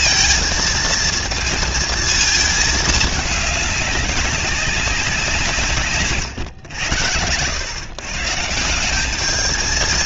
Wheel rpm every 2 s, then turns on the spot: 230, 220, 190, 90, 190.
none